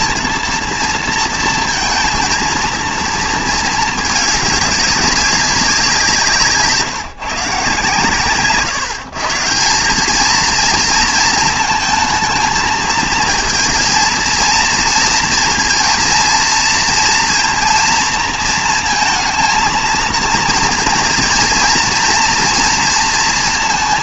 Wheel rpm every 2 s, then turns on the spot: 230, 230, 200, 160, 140, 230, 230, 230, 230, 230, 230, 240.
none